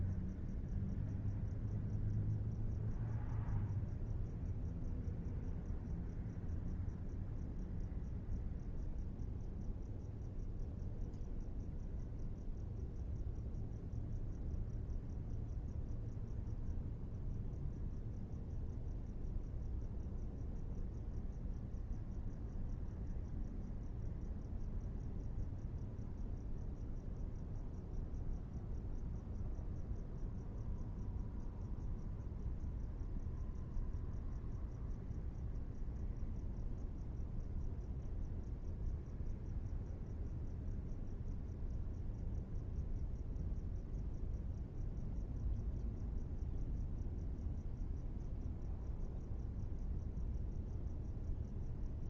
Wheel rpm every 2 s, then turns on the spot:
0, 0, 0, 0, 0, 0, 0, 0, 0, 0, 0, 0, 0, 0, 0, 0, 0, 0, 0, 0, 0, 0, 0, 0, 0, 0.
none